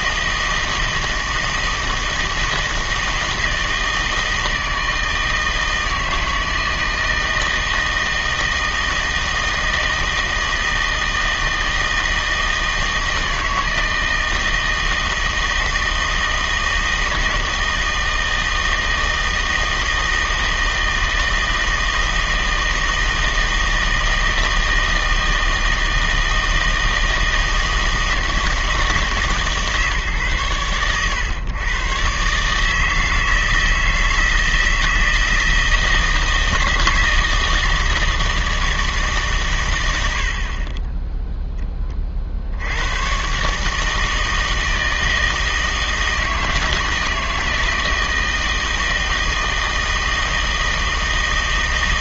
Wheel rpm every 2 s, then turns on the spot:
160, 160, 160, 160, 160, 160, 160, 160, 160, 160, 160, 160, 160, 160, 160, 120, 150, 160, 160, 160, 20, 90, 160, 160, 160, 160.
40-42